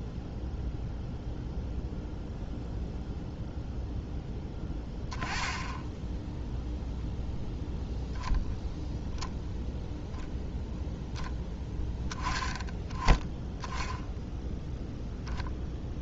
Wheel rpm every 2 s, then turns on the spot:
0, 0, 10, 0, 0, 0, 10, 0.
none